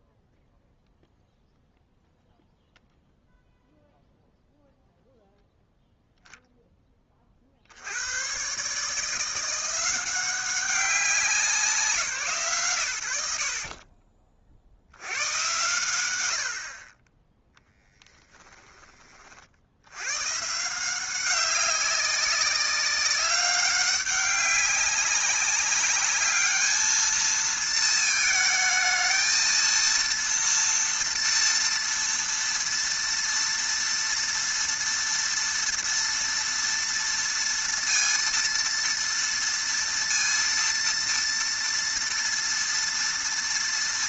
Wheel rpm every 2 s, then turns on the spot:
0, 0, 0, 10, 150, 190, 90, 60, 40, 20, 170, 200, 200, 220, 220, 230, 230, 230, 230, 230, 230, 230.
none